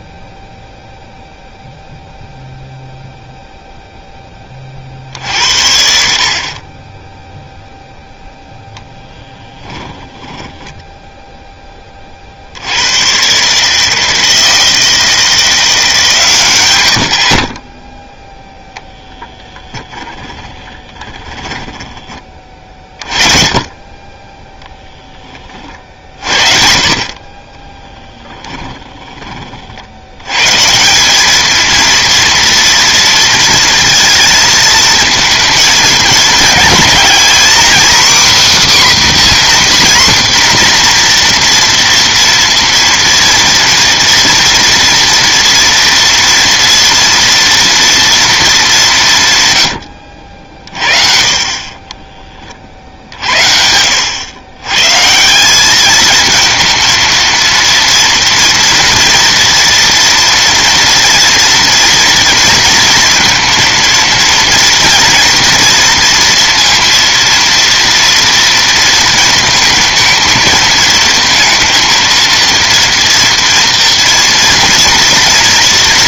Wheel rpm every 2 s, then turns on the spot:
0, 0, 60, 10, 10, 20, 150, 160, 10, 20, 20, 30, 50, 20, 60, 230, 230, 230, 280, 260, 230, 240, 230, 230, 90, 30, 70, 190, 230, 230, 230, 230, 230, 230, 230, 230, 230, 230.
8-10 18-20 26-28